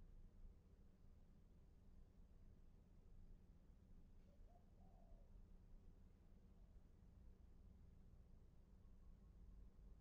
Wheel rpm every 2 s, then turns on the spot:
0, 0, 0, 0, 0.
none